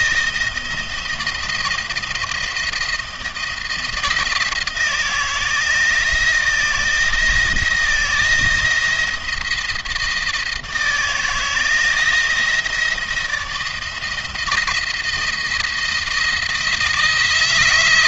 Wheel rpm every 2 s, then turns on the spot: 160, 170, 160, 160, 160, 160, 160, 170, 170.
none